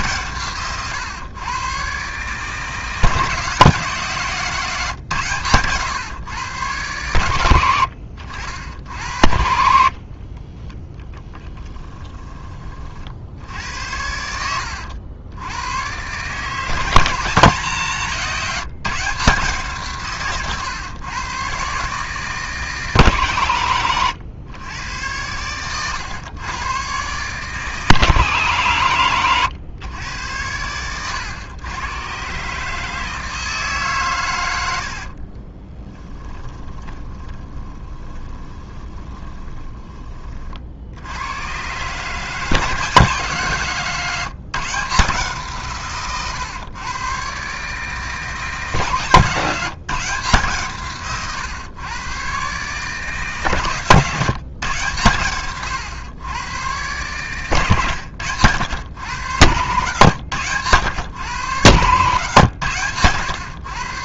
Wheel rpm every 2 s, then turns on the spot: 130, 150, 160, 110, 70, 20, 30, 80, 160, 170, 120, 150, 110, 130, 130, 100, 140, 90, 20, 20, 70, 170, 160, 120, 150, 150, 140, 140, 110, 120, 110, 120.
10-12 14-16 36-40